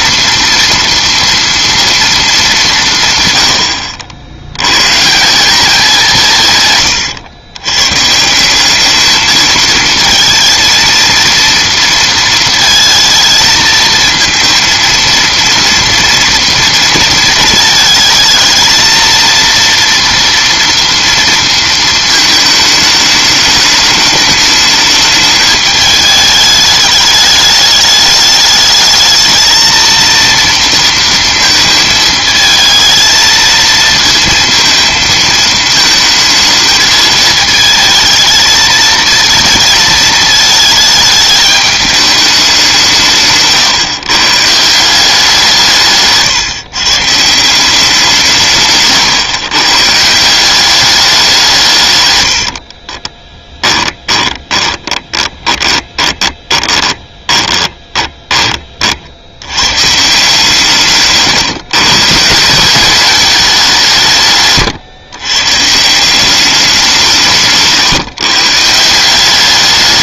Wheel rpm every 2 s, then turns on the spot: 230, 180, 110, 130, 190, 230, 230, 230, 230, 230, 230, 220, 210, 210, 210, 230, 220, 230, 220, 230, 220, 180, 160, 150, 150, 200, 50, 20, 10, 20, 140, 170, 130, 190, 160.
6-8 52-58